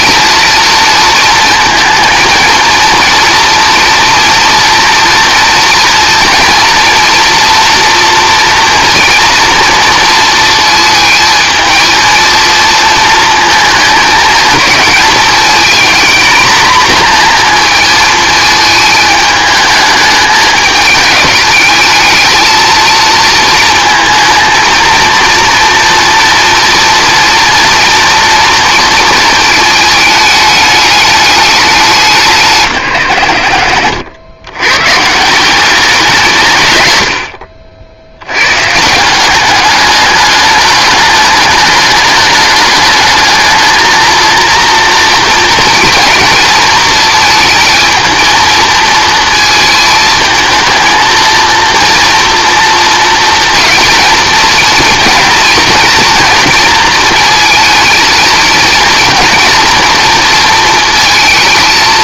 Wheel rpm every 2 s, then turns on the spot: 230, 230, 230, 230, 230, 230, 230, 220, 230, 220, 210, 220, 220, 230, 230, 210, 160, 100, 150, 120, 210, 210, 230, 230, 220, 220, 240, 220, 230, 230, 230.
none